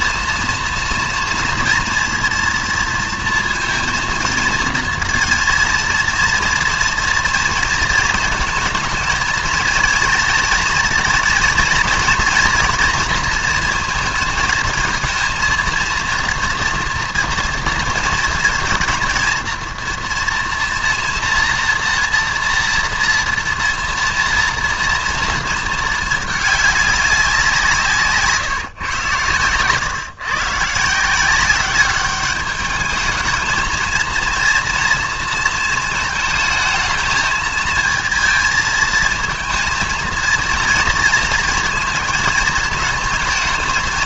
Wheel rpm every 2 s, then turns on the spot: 230, 230, 230, 230, 220, 230, 230, 220, 230, 230, 230, 230, 230, 210, 140, 150, 210, 230, 220, 220, 230, 220.
none